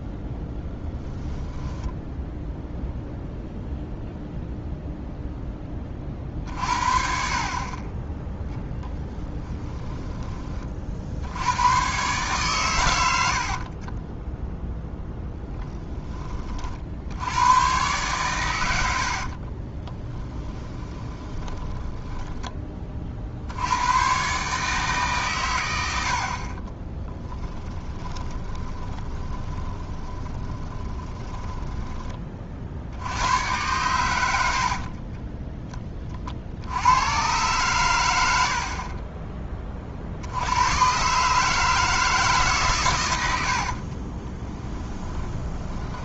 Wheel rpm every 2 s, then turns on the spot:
0, 0, 0, 50, 10, 50, 110, 10, 70, 90, 20, 30, 150, 20, 20, 20, 70, 40, 90, 40, 120, 120, 20.
8-10 18-22 26-32 34-36 38-40 44-46